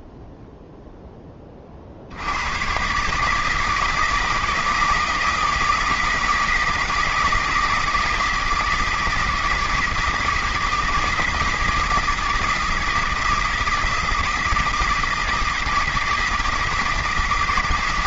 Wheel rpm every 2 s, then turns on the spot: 60, 160, 160, 160, 160, 160, 160, 160, 160.
none